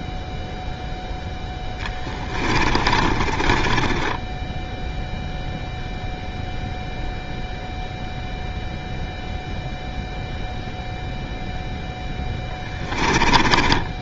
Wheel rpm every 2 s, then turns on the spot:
0, 20, 10, 0, 0, 0, 10.
2-6 12-14